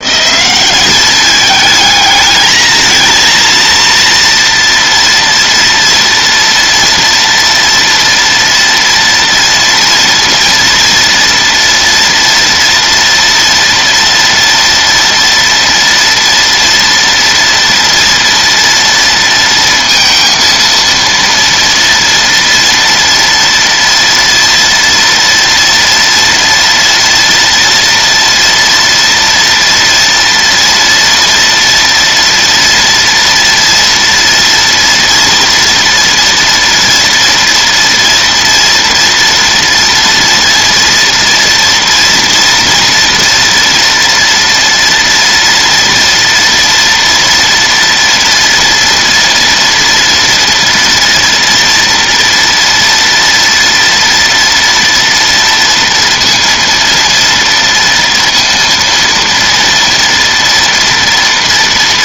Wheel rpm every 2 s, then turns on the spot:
200, 220, 230, 230, 230, 230, 240, 230, 240, 230, 230, 230, 230, 230, 230, 230, 230, 230, 230, 230, 230, 240, 230, 230, 230, 230, 230, 230, 230, 230, 240.
none